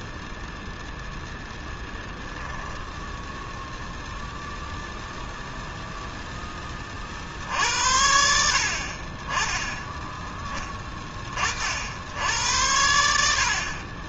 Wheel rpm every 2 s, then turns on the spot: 0, 10, 0, 20, 60, 10, 80.
none